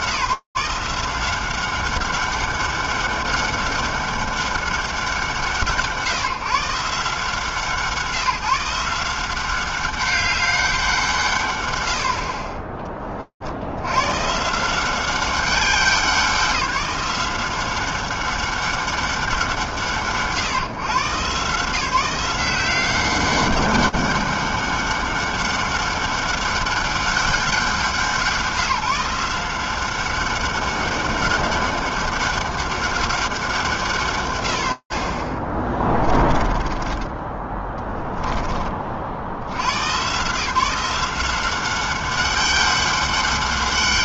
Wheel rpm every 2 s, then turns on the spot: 170, 200, 200, 140, 160, 200, 40, 170, 190, 200, 150, 180, 200, 200, 180, 190, 200, 100, 20, 10, 170, 200.
36-38